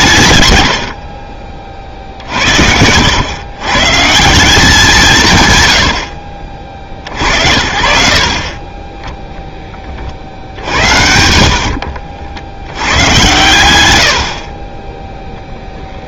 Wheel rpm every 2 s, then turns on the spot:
100, 60, 180, 50, 30, 80, 90, 40.
10-12